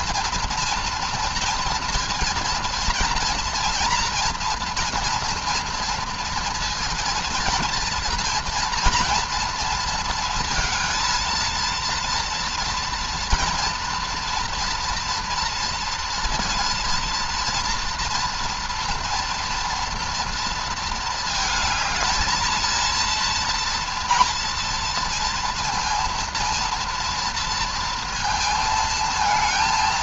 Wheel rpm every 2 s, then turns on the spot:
230, 230, 230, 230, 230, 230, 230, 230, 230, 230, 220, 230, 230, 230, 220.
none